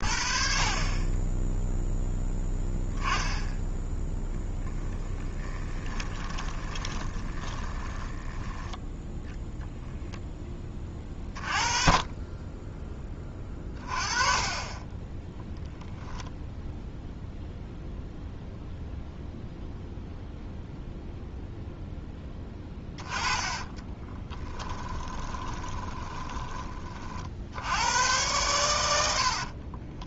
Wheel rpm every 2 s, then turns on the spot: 30, 10, 0, 20, 10, 10, 20, 20, 0, 0, 0, 20, 10, 30, 100.
6-8 14-16 22-26